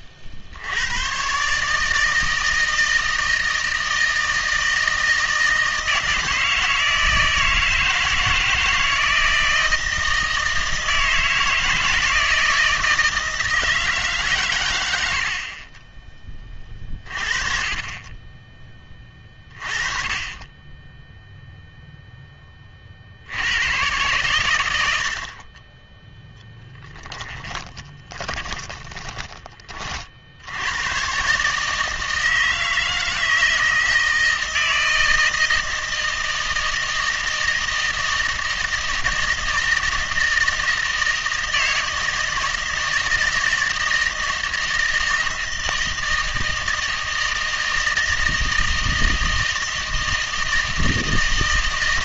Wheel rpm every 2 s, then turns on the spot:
100, 160, 160, 160, 160, 160, 160, 100, 30, 20, 10, 50, 80, 10, 10, 110, 160, 160, 160, 160, 160, 160, 160, 160, 160, 160.
26-30